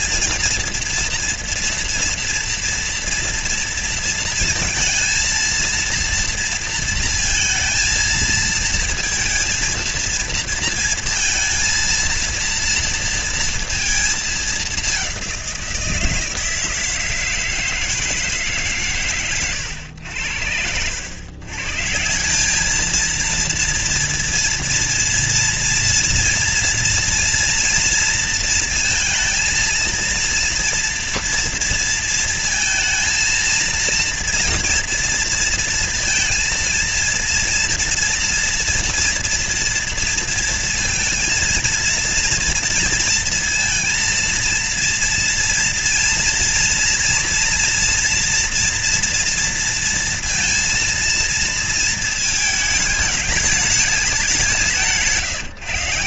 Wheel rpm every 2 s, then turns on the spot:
230, 230, 230, 230, 230, 230, 230, 210, 160, 140, 90, 200, 230, 230, 230, 230, 230, 230, 230, 230, 230, 230, 230, 230, 230, 230, 220, 190.
none